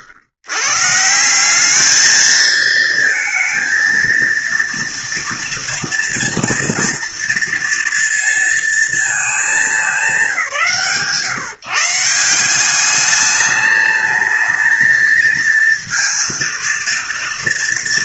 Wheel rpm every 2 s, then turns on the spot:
140, 230, 240, 240, 220, 170, 210, 230, 220.
none